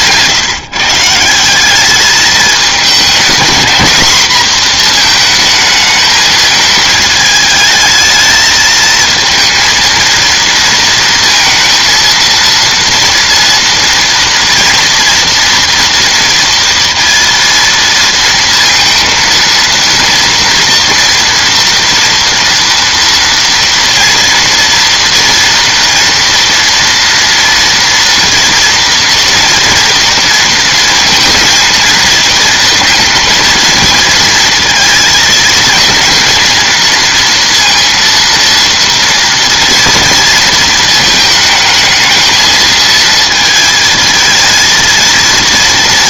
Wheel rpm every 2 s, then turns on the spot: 160, 210, 230, 220, 220, 230, 230, 230, 230, 230, 230, 230, 230, 240, 230, 230, 230, 230, 230, 230, 220, 230, 230.
none